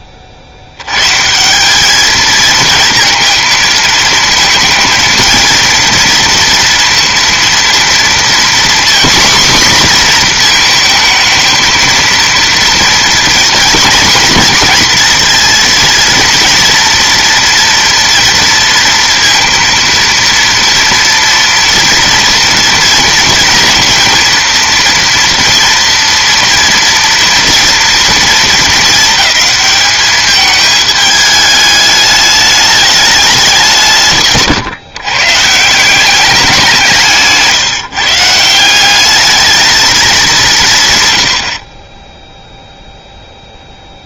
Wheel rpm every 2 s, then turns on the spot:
90, 220, 230, 230, 250, 230, 230, 230, 230, 230, 230, 230, 230, 230, 220, 210, 210, 140, 180, 180, 150, 0.
none